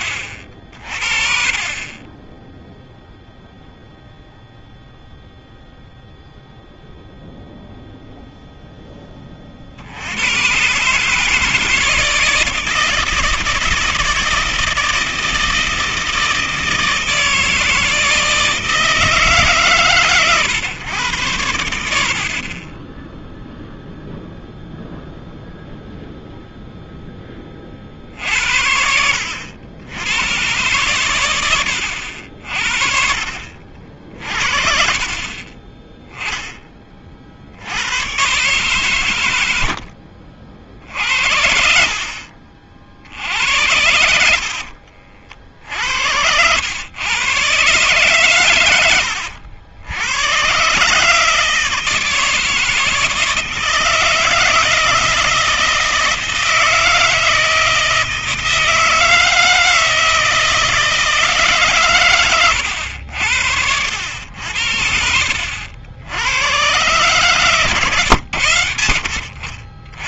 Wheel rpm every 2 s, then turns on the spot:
40, 0, 0, 0, 50, 160, 160, 160, 160, 140, 80, 0, 0, 20, 70, 110, 40, 30, 70, 80, 60, 70, 60, 120, 90, 150, 160, 160, 160, 160, 160, 90, 70, 120, 90.
42-46 48-50